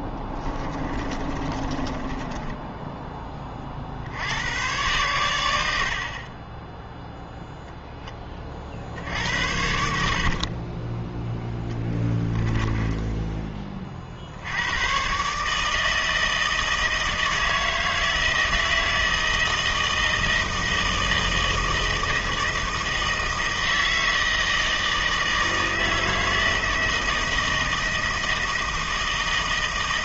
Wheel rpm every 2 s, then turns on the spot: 20, 10, 100, 10, 50, 20, 20, 110, 160, 160, 160, 160, 160, 160, 160.
0-4 10-14